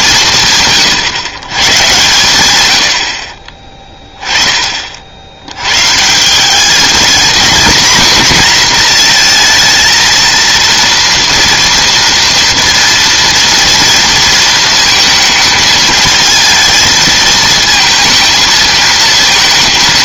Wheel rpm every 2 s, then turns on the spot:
130, 80, 50, 210, 230, 230, 230, 220, 220, 220.
none